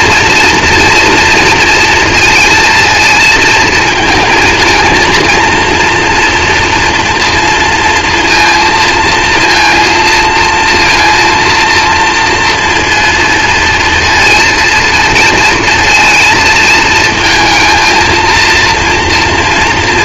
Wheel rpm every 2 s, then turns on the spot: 230, 230, 220, 230, 230, 230, 230, 220, 230, 230.
none